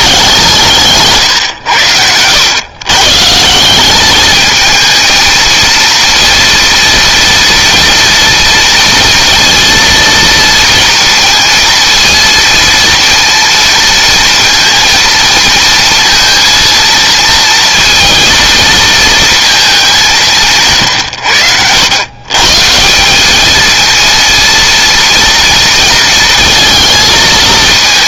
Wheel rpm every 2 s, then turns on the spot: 150, 140, 220, 230, 230, 230, 230, 230, 230, 230, 150, 180, 230, 230.
none